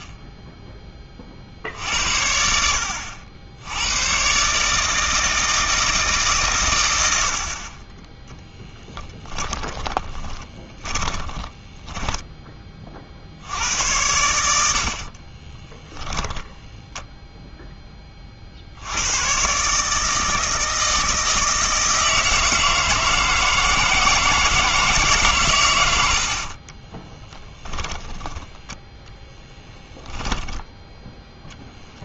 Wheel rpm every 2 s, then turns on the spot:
10, 70, 140, 130, 10, 20, 20, 70, 0, 60, 160, 160, 160, 40, 10, 20.
10-12 26-28 30-32